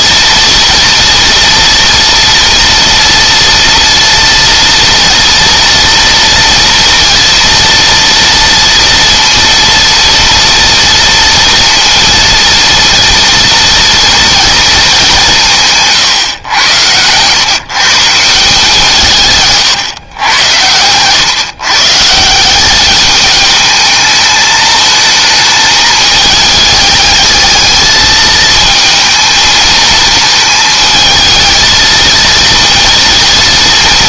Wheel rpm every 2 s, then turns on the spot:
230, 230, 230, 230, 230, 230, 230, 220, 110, 160, 100, 200, 220, 210, 220, 220, 230.
none